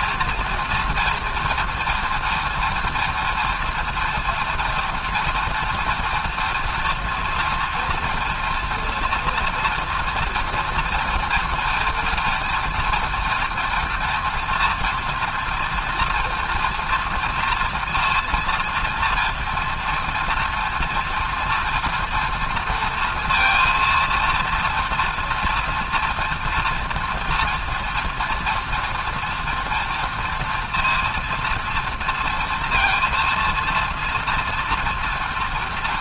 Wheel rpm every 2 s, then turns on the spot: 240, 230, 230, 230, 230, 240, 240, 240, 230, 230, 230, 230, 230, 230, 230, 230, 230, 230.
none